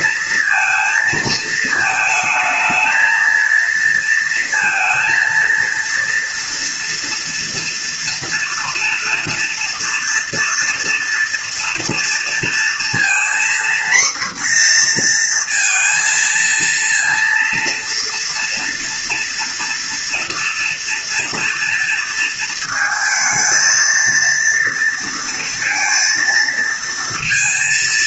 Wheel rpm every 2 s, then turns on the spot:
230, 220, 230, 230, 230, 230, 230, 240, 230, 230, 230, 230, 230, 230.
none